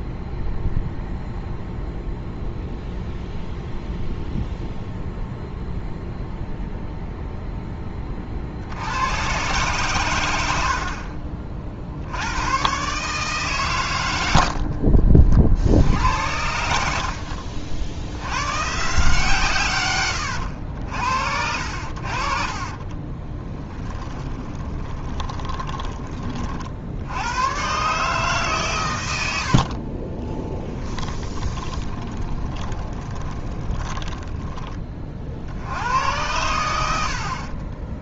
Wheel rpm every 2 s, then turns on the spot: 0, 0, 0, 0, 70, 70, 130, 60, 70, 130, 80, 30, 20, 60, 120, 20, 20, 20, 90.
14-16 22-26 30-34